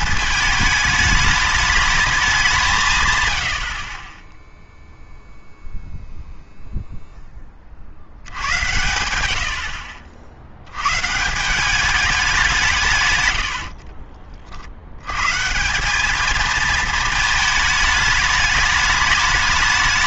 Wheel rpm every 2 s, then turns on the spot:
210, 170, 0, 0, 100, 120, 170, 60, 220, 210.
none